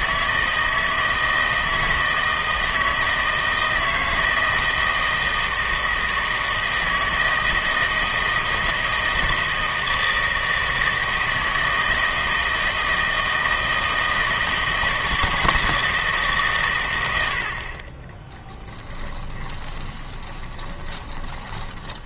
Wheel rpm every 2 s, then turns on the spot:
160, 160, 160, 160, 160, 160, 160, 160, 120, 20, 20.
18-22